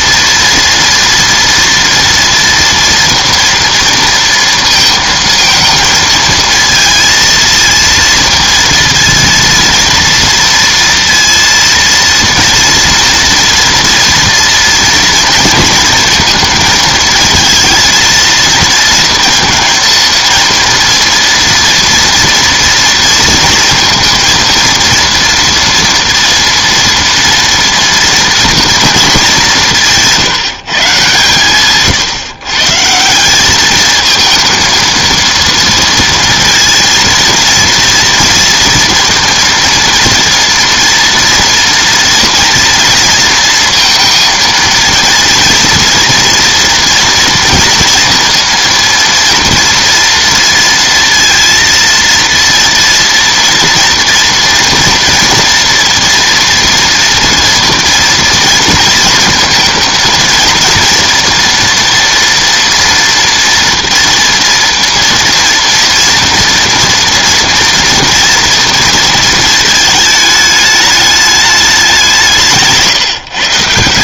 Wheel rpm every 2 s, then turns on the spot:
230, 230, 220, 230, 230, 230, 230, 230, 220, 230, 230, 230, 230, 230, 230, 150, 150, 220, 230, 230, 230, 230, 230, 240, 230, 230, 230, 230, 230, 230, 230, 230, 230, 230, 240, 210, 160.
none